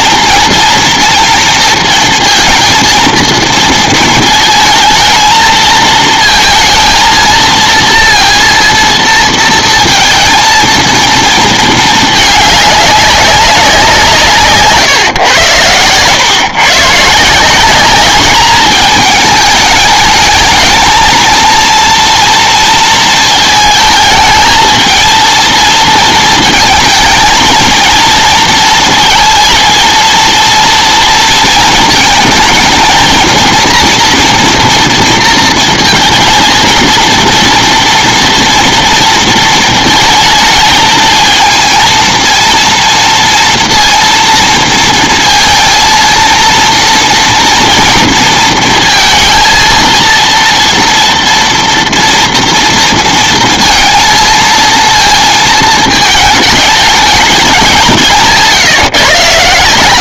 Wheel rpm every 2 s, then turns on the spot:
220, 230, 220, 230, 230, 230, 200, 130, 130, 220, 220, 230, 220, 220, 230, 230, 230, 230, 220, 230, 220, 230, 230, 230, 230, 230, 230, 230, 210, 140.
14-16